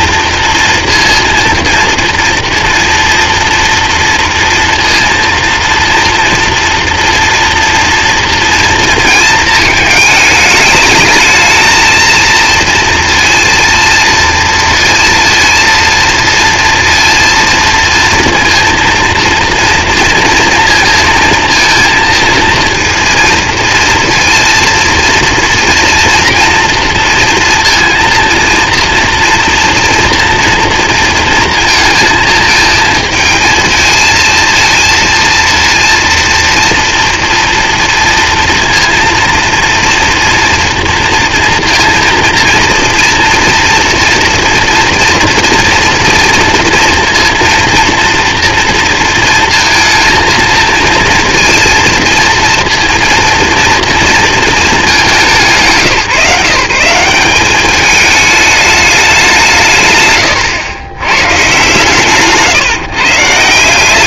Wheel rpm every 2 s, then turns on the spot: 230, 230, 230, 230, 230, 210, 230, 230, 230, 230, 230, 230, 230, 230, 230, 230, 230, 230, 230, 230, 240, 230, 230, 230, 230, 230, 230, 220, 170, 210, 110, 140.
none